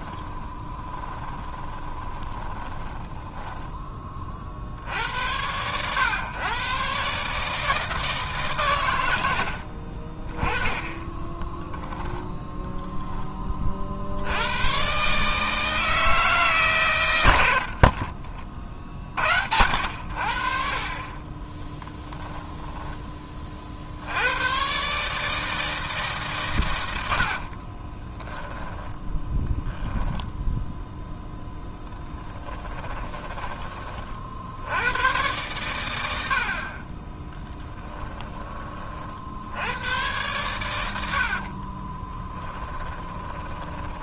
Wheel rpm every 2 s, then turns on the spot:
20, 20, 60, 130, 130, 20, 0, 110, 130, 60, 40, 10, 130, 110, 10, 0, 20, 90, 30, 20, 90, 10.
0-4 28-30 32-34 42-44